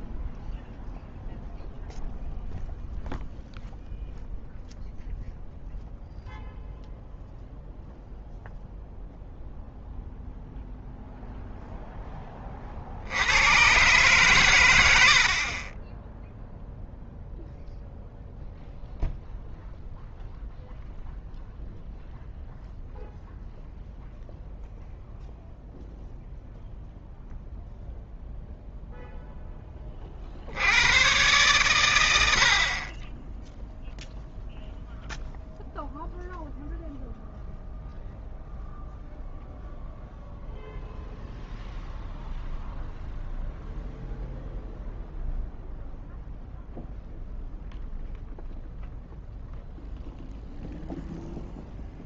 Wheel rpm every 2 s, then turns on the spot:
0, 0, 0, 0, 0, 0, 50, 100, 0, 0, 0, 0, 0, 0, 0, 90, 50, 0, 0, 0, 0, 0, 0, 0, 0, 0.
none